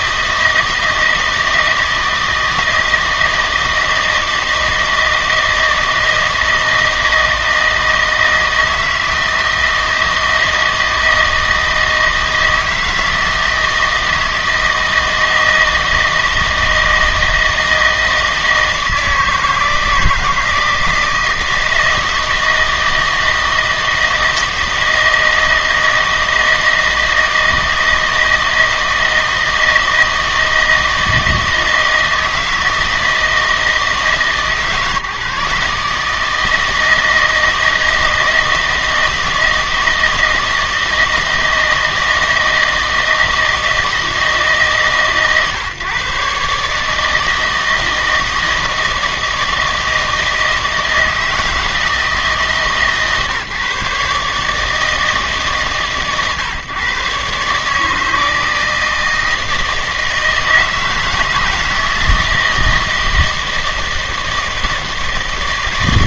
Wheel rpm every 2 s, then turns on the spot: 160, 160, 160, 160, 160, 160, 160, 160, 160, 160, 170, 160, 160, 160, 160, 160, 160, 150, 160, 160, 160, 160, 150, 150, 160, 160, 150, 150, 140, 160, 160, 160, 160.
none